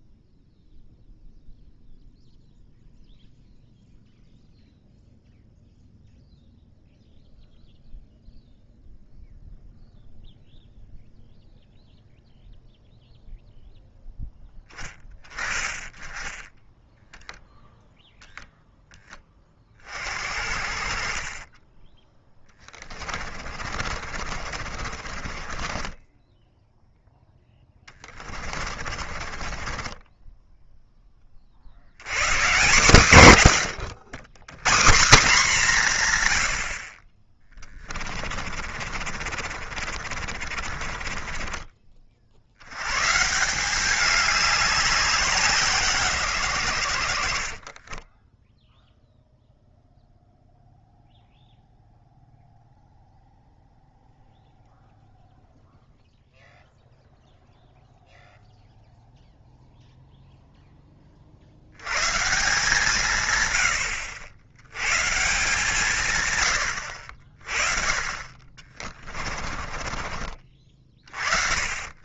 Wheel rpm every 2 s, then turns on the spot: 0, 0, 0, 0, 0, 0, 0, 10, 10, 10, 50, 20, 40, 0, 40, 10, 140, 140, 50, 50, 40, 100, 190, 100, 0, 0, 0, 0, 0, 0, 20, 160, 110, 70, 30, 30.
22-26 28-30 38-42 68-70